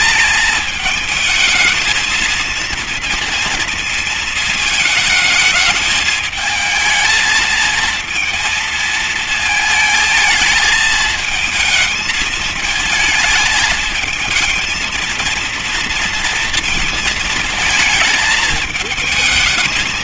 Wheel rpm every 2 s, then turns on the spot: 230, 230, 220, 230, 220, 220, 230, 230, 220, 220.
none